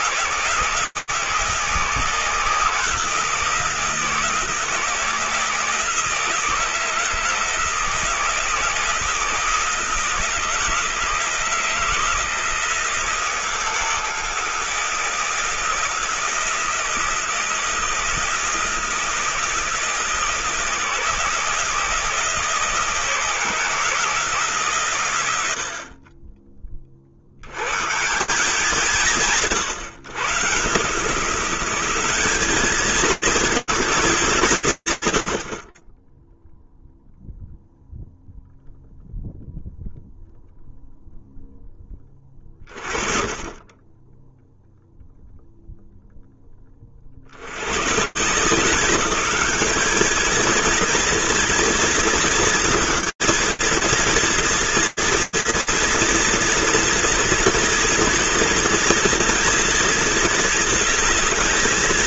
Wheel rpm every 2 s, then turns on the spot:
160, 160, 160, 160, 160, 160, 170, 160, 160, 160, 160, 160, 150, 20, 160, 140, 210, 150, 0, 0, 0, 30, 0, 80, 210, 230, 220, 230, 230, 230, 220.
none